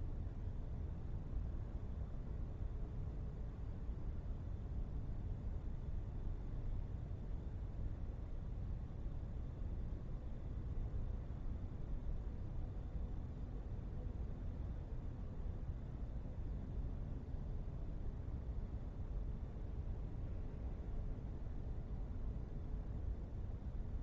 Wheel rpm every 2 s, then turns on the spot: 0, 0, 0, 0, 0, 0, 0, 0, 0, 0, 0, 0.
none